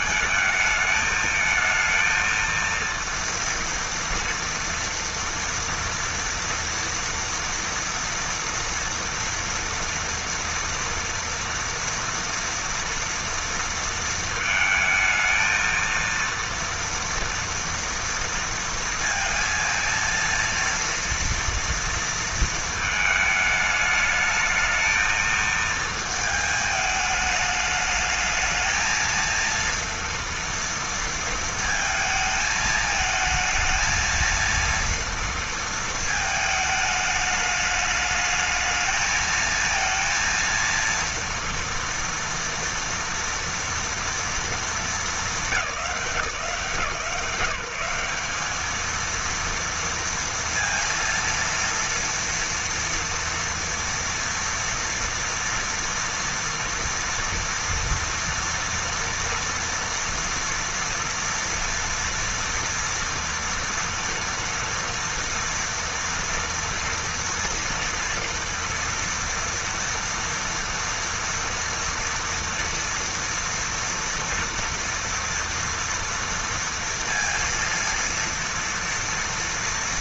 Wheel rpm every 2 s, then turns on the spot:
220, 230, 240, 230, 230, 230, 230, 220, 230, 230, 230, 220, 220, 220, 220, 230, 220, 230, 220, 220, 230, 230, 230, 160, 210, 230, 240, 230, 230, 230, 240, 230, 230, 230, 230, 230, 230, 230, 230, 230.
none